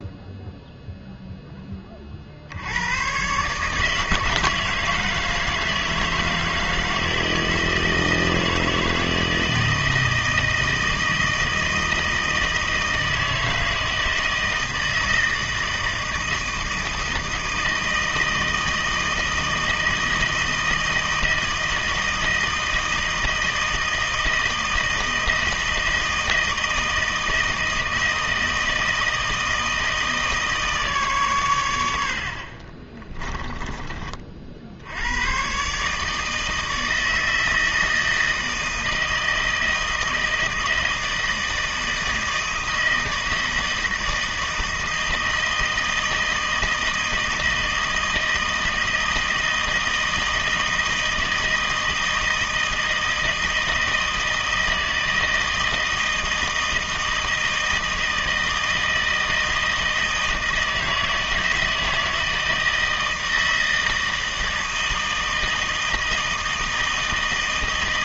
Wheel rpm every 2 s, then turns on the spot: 0, 80, 160, 160, 160, 160, 160, 160, 160, 160, 160, 160, 160, 160, 160, 150, 30, 70, 160, 160, 160, 160, 160, 160, 160, 160, 160, 160, 160, 160, 160, 160, 160, 160.
32-34